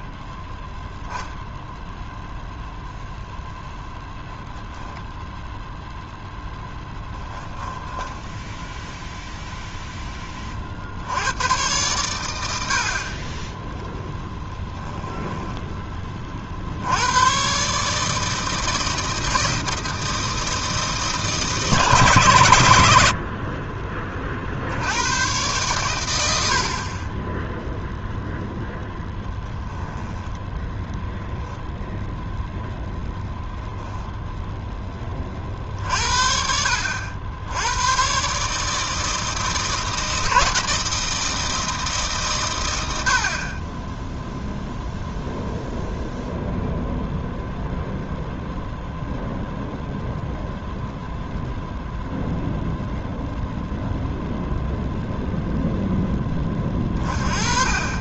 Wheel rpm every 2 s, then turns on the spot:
40, 0, 10, 0, 10, 20, 90, 10, 40, 160, 160, 130, 40, 80, 0, 10, 0, 0, 60, 140, 160, 120, 0, 0, 0, 0, 0, 0, 20.
8-10 14-16 30-32